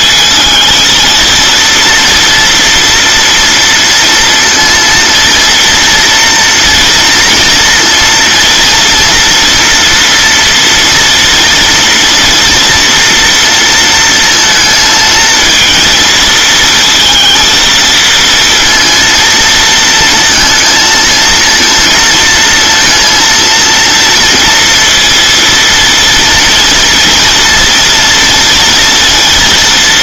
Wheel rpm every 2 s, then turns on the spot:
230, 240, 230, 230, 240, 230, 230, 230, 230, 230, 230, 230, 230, 230, 230.
none